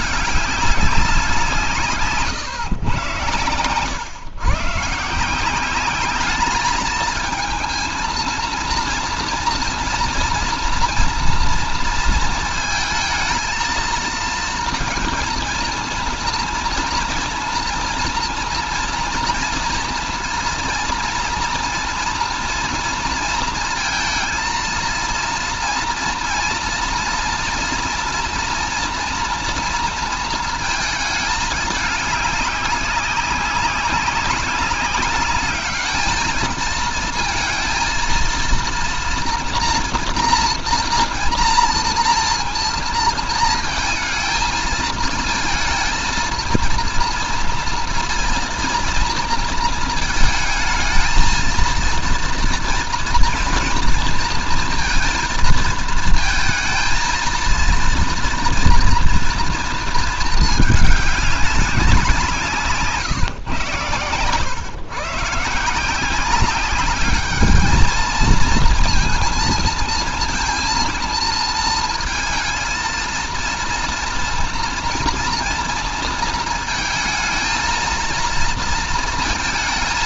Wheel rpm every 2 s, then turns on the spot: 200, 120, 150, 220, 230, 230, 230, 230, 230, 230, 230, 230, 230, 230, 240, 220, 190, 190, 220, 230, 240, 230, 230, 230, 230, 220, 230, 230, 230, 230, 210, 160, 120, 190, 220, 230, 220, 230, 230, 230.
none